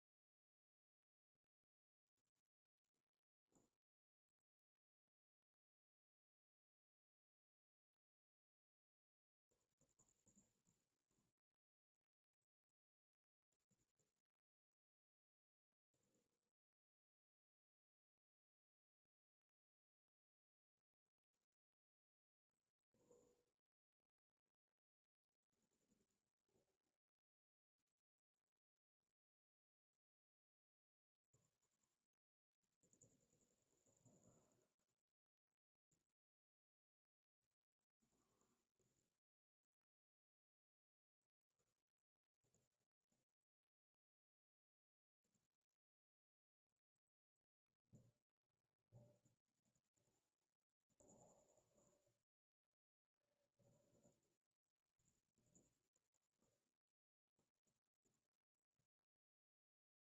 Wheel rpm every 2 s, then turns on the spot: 0, 0, 0, 0, 0, 0, 0, 0, 0, 0, 0, 0, 0, 0, 0, 0, 0, 0, 0, 0, 0, 0, 0, 0, 0, 0, 0, 0, 0, 0.
none